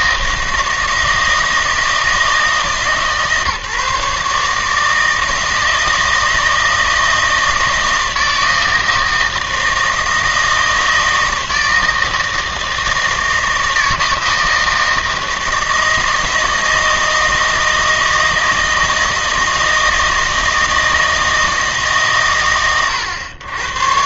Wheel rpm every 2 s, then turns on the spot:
160, 150, 150, 160, 160, 160, 160, 160, 160, 160, 160, 110.
none